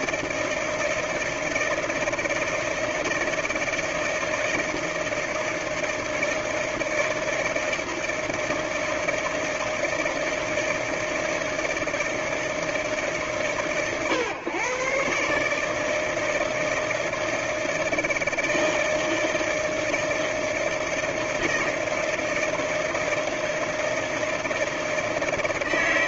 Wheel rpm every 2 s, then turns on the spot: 160, 160, 160, 160, 160, 160, 160, 120, 160, 160, 160, 160, 160.
none